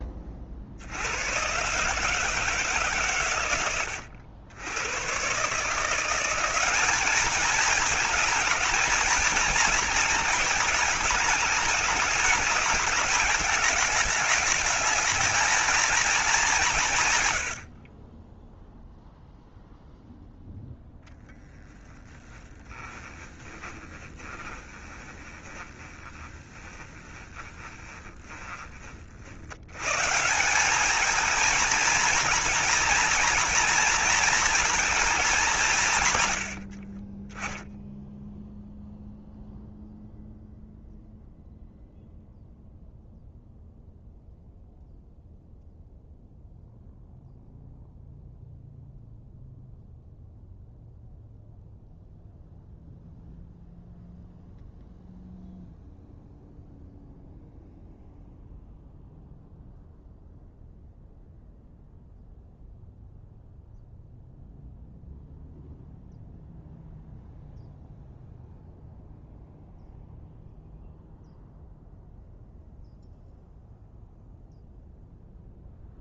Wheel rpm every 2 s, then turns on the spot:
50, 160, 90, 190, 220, 220, 220, 220, 190, 10, 0, 10, 20, 20, 30, 180, 240, 230, 90, 0, 0, 0, 0, 0, 0, 0, 0, 0, 0, 0, 0, 0, 0, 0, 0, 0, 0, 0.
22-30 36-38